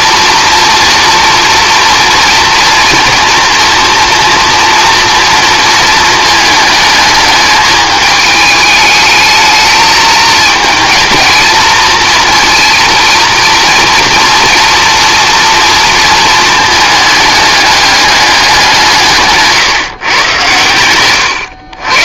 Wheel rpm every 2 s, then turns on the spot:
230, 230, 230, 220, 210, 220, 230, 230, 220, 180, 100.
none